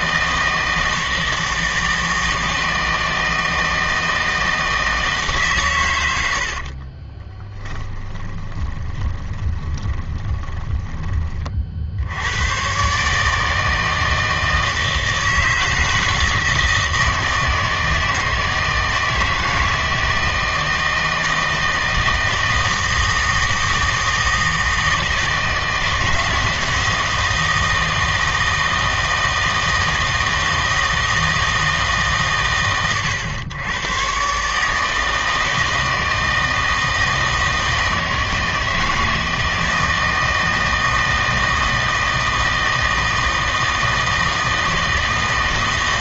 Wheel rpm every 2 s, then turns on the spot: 160, 160, 160, 50, 20, 20, 130, 160, 160, 160, 160, 160, 160, 160, 160, 160, 120, 150, 160, 160, 160, 160, 160.
6-12